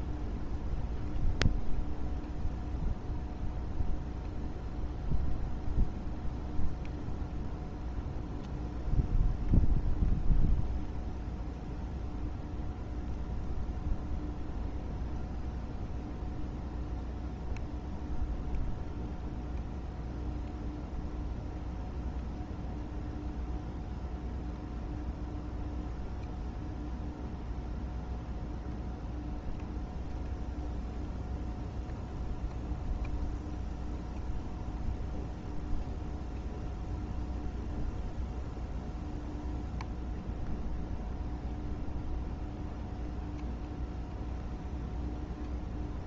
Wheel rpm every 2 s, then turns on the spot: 0, 0, 0, 0, 0, 0, 0, 0, 0, 0, 0, 0, 0, 0, 0, 0, 0, 0, 0, 0, 0, 0, 0.
none